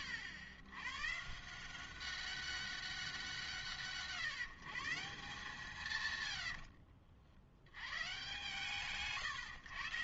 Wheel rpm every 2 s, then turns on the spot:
120, 190, 160, 50, 120.
6-8